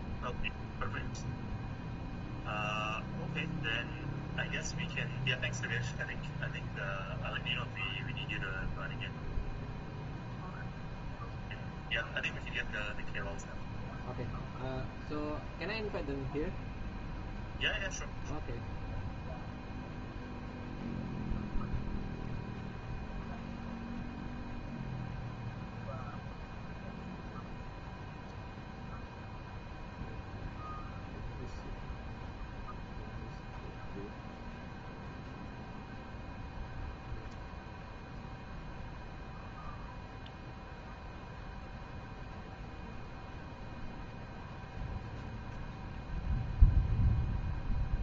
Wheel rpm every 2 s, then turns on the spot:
0, 0, 0, 0, 0, 0, 0, 0, 0, 0, 0, 0, 0, 0, 0, 0, 0, 0, 0, 0, 0, 0, 0, 0.
none